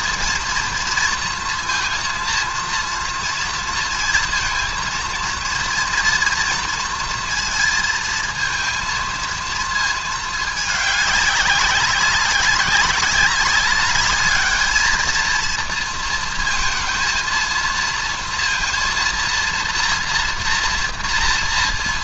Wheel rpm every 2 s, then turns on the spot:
230, 230, 230, 230, 230, 220, 190, 210, 230, 230, 230.
none